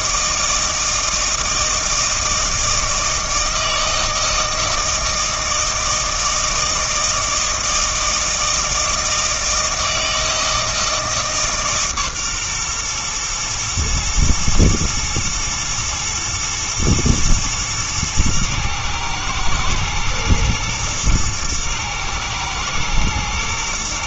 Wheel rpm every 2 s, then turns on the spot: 160, 160, 160, 160, 160, 160, 120, 120, 120, 110, 120, 120.
none